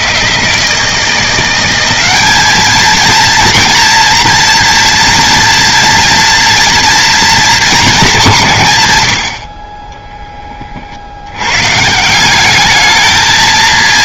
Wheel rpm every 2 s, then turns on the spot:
170, 220, 230, 240, 120, 50, 210.
none